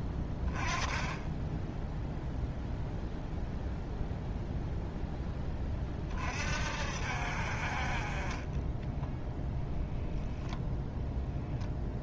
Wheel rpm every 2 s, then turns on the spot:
20, 0, 0, 60, 20, 0.
none